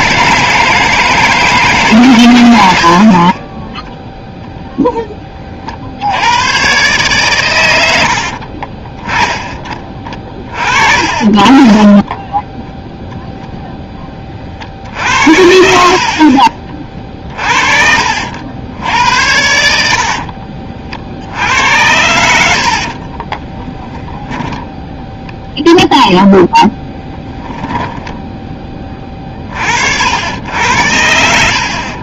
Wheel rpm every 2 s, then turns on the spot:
160, 90, 0, 120, 40, 40, 10, 50, 30, 80, 50, 70, 10, 10, 20, 80.
8-10 20-24 26-28